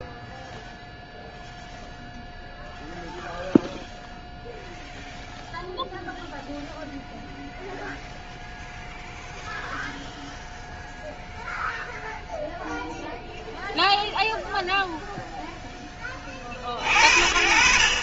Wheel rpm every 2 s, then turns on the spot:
0, 0, 0, 0, 0, 0, 0, 0, 40.
none